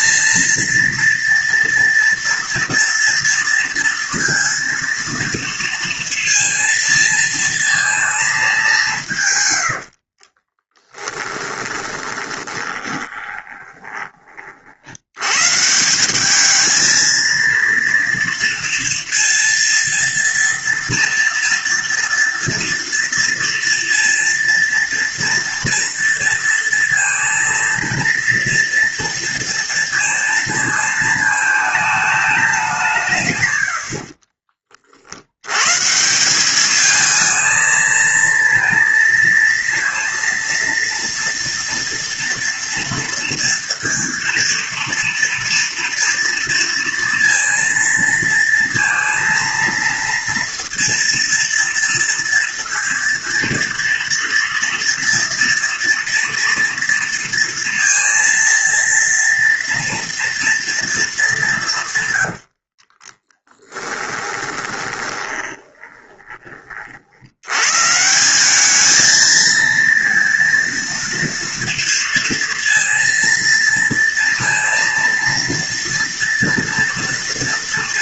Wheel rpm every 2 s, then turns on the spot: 230, 230, 230, 230, 190, 20, 20, 50, 210, 230, 230, 230, 230, 230, 230, 220, 180, 50, 200, 230, 230, 230, 230, 230, 230, 230, 230, 230, 230, 230, 230, 60, 20, 40, 200, 230, 230, 230, 230.
10-14 62-66